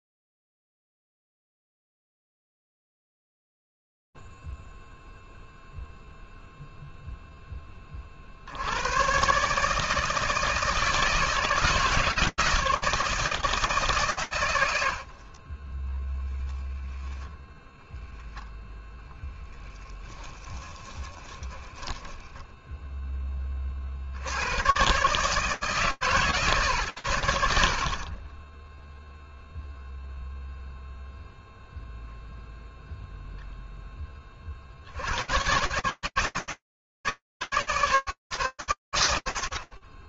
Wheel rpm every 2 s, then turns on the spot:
0, 0, 0, 0, 90, 160, 160, 80, 0, 10, 20, 60, 140, 30, 0, 0, 40, 160, 150, 100.
20-22